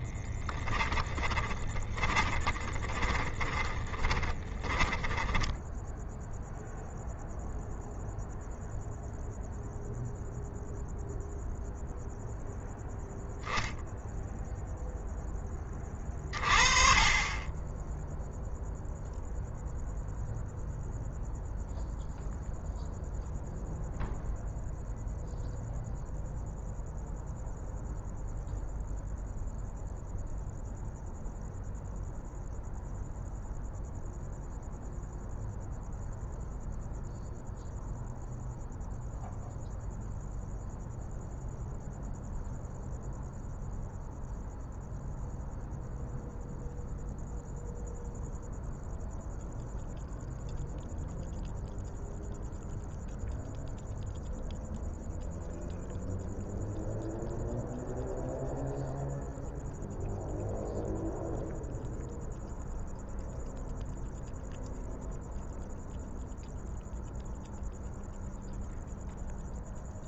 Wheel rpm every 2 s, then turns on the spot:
20, 20, 10, 0, 0, 0, 0, 0, 40, 0, 0, 0, 0, 0, 0, 0, 0, 0, 0, 0, 0, 0, 0, 0, 0, 0, 0, 0, 0, 0, 0, 0, 0, 0, 0.
0-6